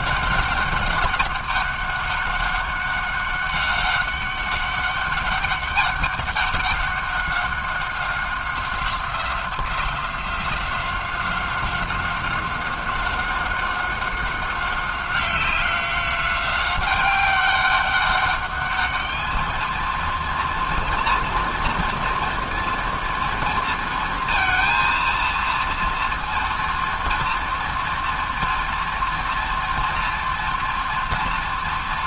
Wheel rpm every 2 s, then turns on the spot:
200, 190, 200, 200, 190, 180, 190, 190, 190, 200, 240, 240, 230, 230, 230, 240.
none